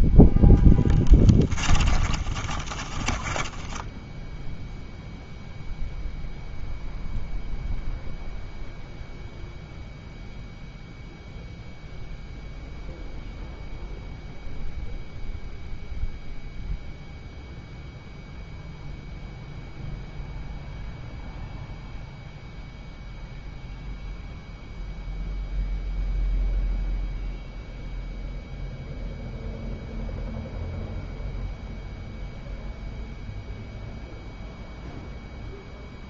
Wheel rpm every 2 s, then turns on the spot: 10, 40, 0, 0, 0, 0, 0, 0, 0, 0, 0, 0, 0, 0, 0, 0, 0, 0.
0-4